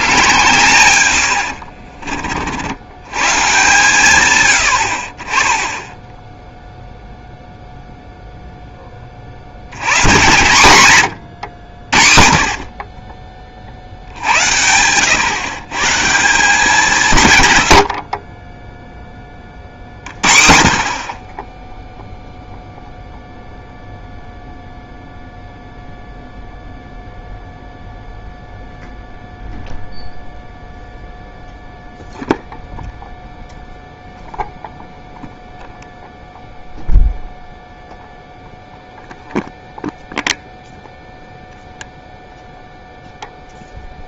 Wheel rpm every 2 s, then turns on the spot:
130, 80, 100, 0, 10, 130, 50, 90, 200, 10, 50, 0, 0, 0, 0, 0, 0, 0, 0, 0, 0, 0.
none